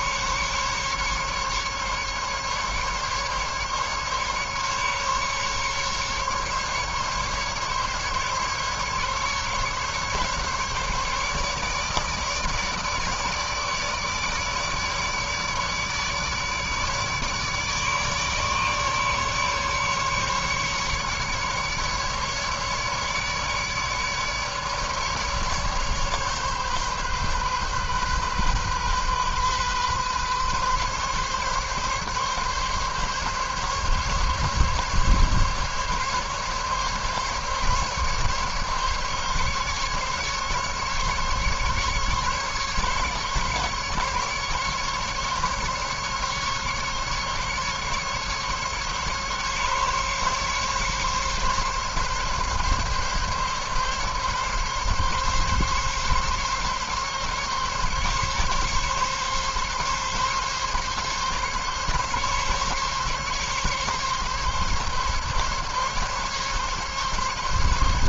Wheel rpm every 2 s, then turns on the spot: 140, 140, 140, 140, 140, 140, 160, 150, 150, 150, 140, 150, 150, 140, 130, 140, 140, 140, 140, 140, 140, 140, 140, 140, 140, 140, 140, 140, 140, 140, 140, 140, 140, 140.
none